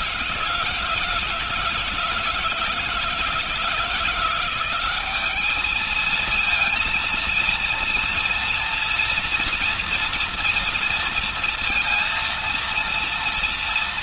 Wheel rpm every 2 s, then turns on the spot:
160, 160, 180, 220, 230, 230, 230.
none